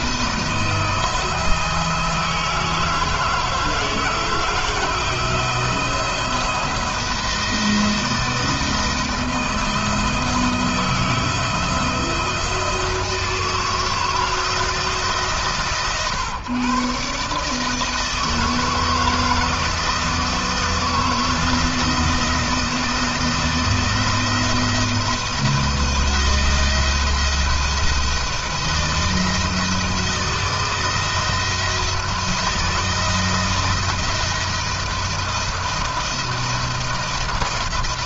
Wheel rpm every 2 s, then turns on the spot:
170, 160, 160, 170, 170, 160, 160, 160, 140, 160, 170, 170, 170, 170, 170, 160, 160, 170, 170.
none